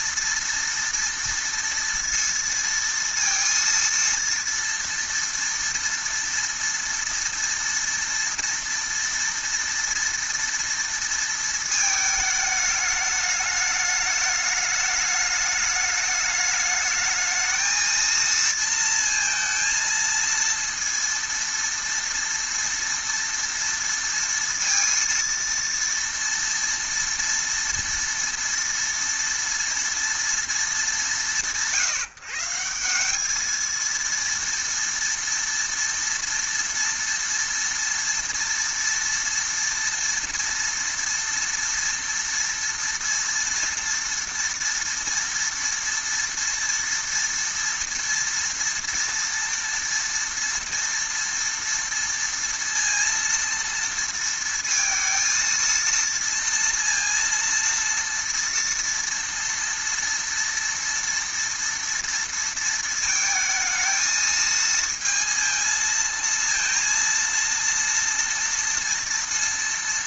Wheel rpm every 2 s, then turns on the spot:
230, 230, 230, 230, 230, 230, 210, 210, 210, 230, 230, 230, 230, 230, 230, 210, 170, 230, 230, 230, 230, 230, 240, 230, 230, 230, 230, 230, 230, 230, 230, 230, 220, 230, 230.
none